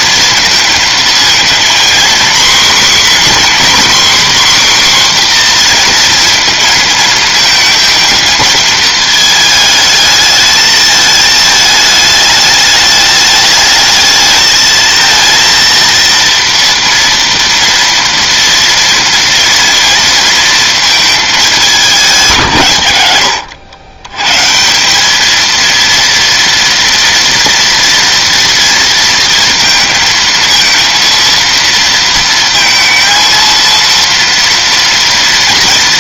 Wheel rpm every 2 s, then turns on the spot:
230, 250, 270, 230, 220, 220, 210, 220, 230, 230, 230, 130, 150, 230, 230, 230, 230, 230.
none